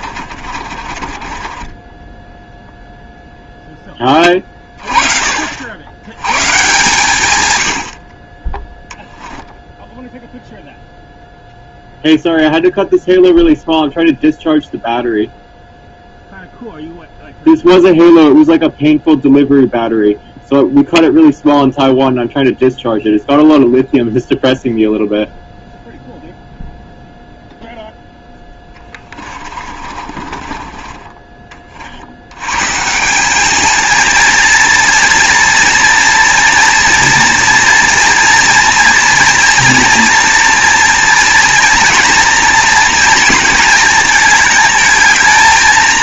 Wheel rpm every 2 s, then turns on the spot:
40, 0, 30, 130, 10, 0, 0, 0, 0, 0, 0, 0, 0, 0, 20, 30, 130, 230, 230, 230, 230, 230, 220.
0-2 28-32